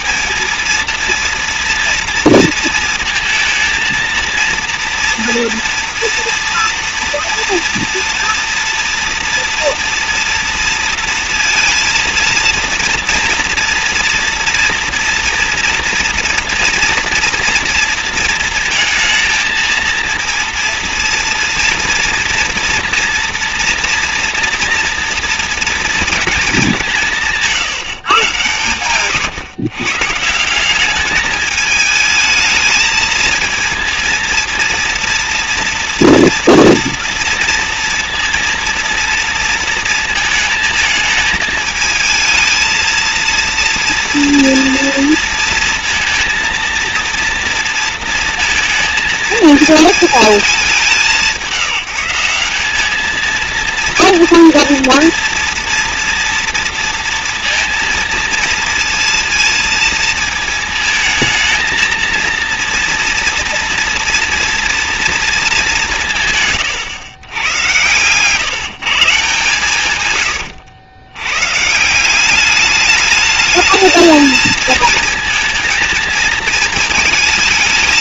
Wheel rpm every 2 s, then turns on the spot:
230, 230, 230, 230, 230, 230, 230, 230, 240, 230, 230, 230, 230, 200, 120, 190, 220, 230, 230, 230, 220, 230, 230, 230, 230, 210, 200, 230, 230, 230, 220, 230, 240, 120, 150, 110, 210, 220, 220.
none